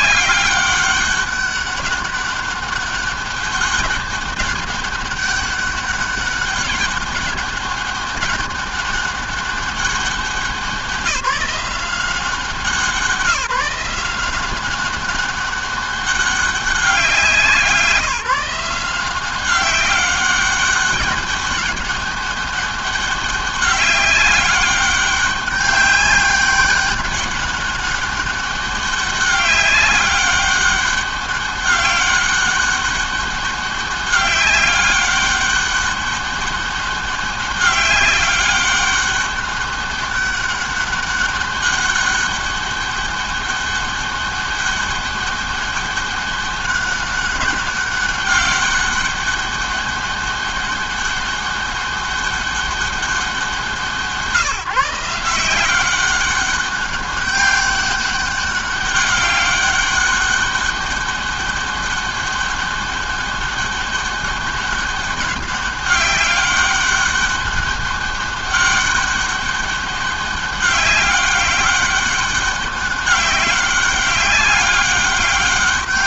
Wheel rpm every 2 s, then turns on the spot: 200, 200, 200, 200, 200, 190, 170, 200, 180, 180, 200, 200, 200, 200, 200, 200, 200, 200, 200, 200, 200, 200, 200, 200, 200, 200, 190, 170, 200, 200, 200, 200, 200, 200, 200, 200, 190, 200.
none